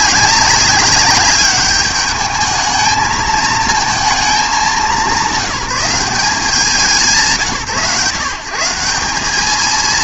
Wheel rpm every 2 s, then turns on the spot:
190, 210, 200, 180, 170.
none